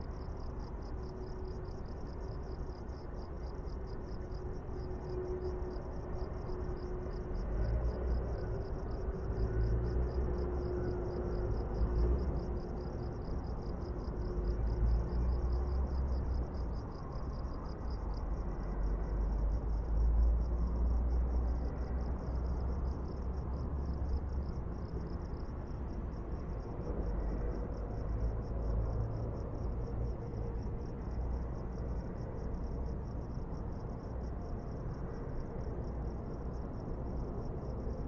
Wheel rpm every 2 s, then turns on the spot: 0, 0, 0, 0, 0, 0, 0, 0, 0, 0, 0, 0, 0, 0, 0, 0, 0, 0, 0.
none